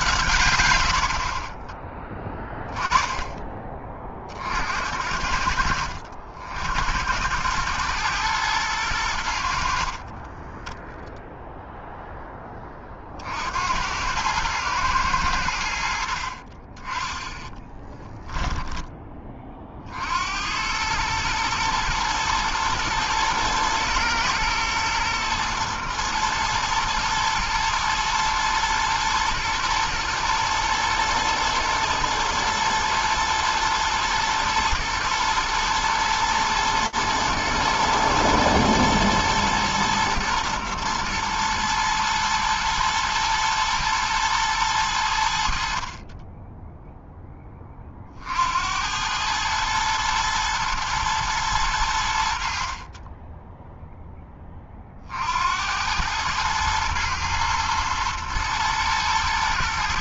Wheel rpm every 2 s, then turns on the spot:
160, 10, 40, 60, 110, 30, 0, 100, 50, 10, 70, 110, 110, 110, 110, 120, 110, 110, 120, 120, 120, 110, 110, 30, 50, 110, 80, 10, 100, 110.
10-12 16-20